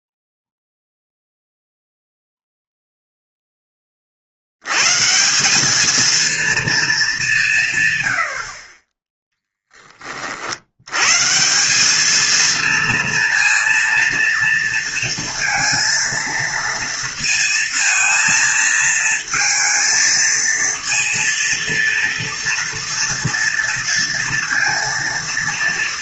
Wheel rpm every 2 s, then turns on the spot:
0, 0, 100, 230, 40, 80, 230, 230, 230, 230, 230, 230, 230.
none